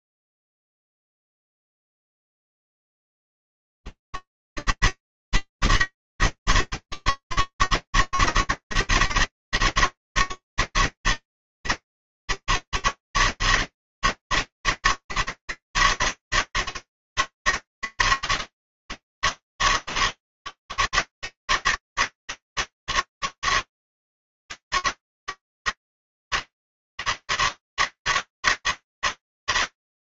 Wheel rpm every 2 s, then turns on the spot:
130, 160, 160, 160, 160, 160, 160, 160, 160, 160, 160, 150, 160, 160, 160.
none